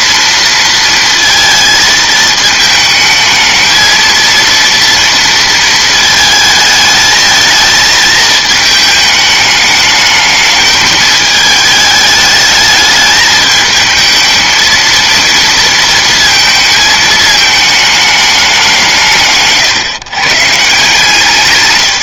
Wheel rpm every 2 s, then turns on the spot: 230, 220, 230, 220, 210, 210, 210, 230, 220, 170, 150.
none